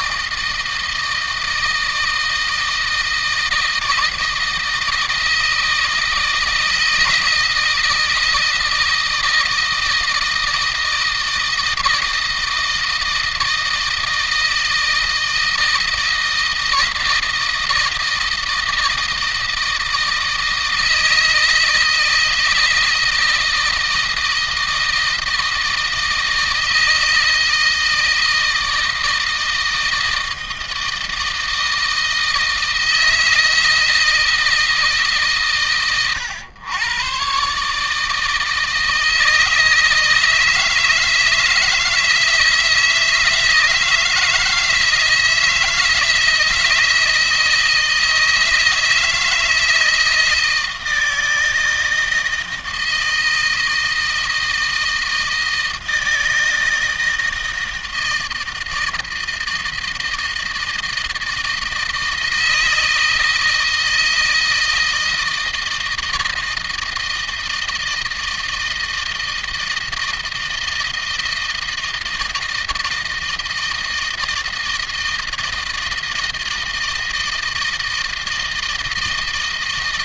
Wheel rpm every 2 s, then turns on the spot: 160, 160, 160, 160, 160, 160, 160, 160, 160, 160, 160, 160, 160, 160, 160, 160, 160, 160, 110, 160, 160, 160, 160, 160, 160, 160, 160, 160, 160, 160, 160, 160, 160, 160, 160, 160, 160, 160, 160, 160.
none